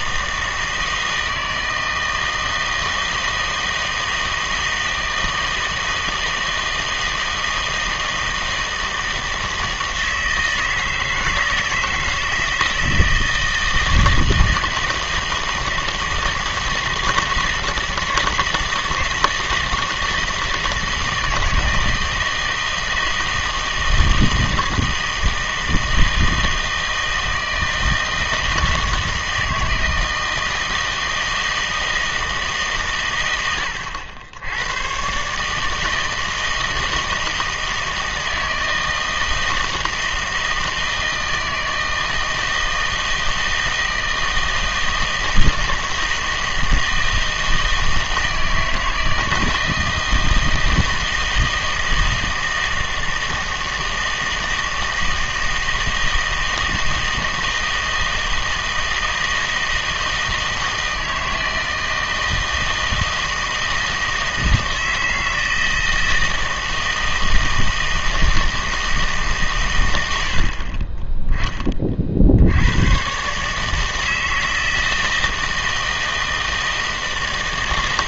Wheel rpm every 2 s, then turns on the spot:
160, 160, 160, 160, 160, 160, 160, 160, 160, 160, 160, 160, 160, 160, 160, 160, 150, 100, 160, 160, 160, 160, 160, 160, 160, 160, 160, 160, 160, 160, 160, 160, 160, 160, 160, 30, 90, 160, 160.
none